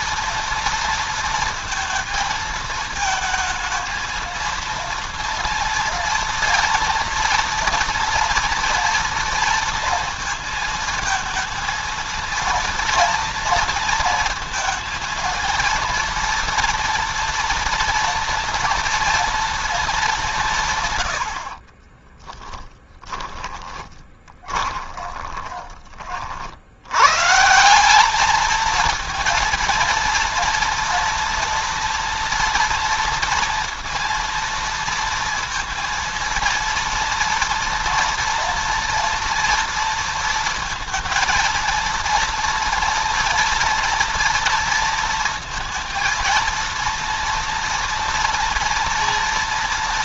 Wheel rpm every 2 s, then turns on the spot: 230, 220, 230, 230, 230, 230, 230, 230, 230, 230, 150, 10, 20, 80, 220, 230, 230, 230, 230, 230, 230, 230, 230, 230, 230.
22-26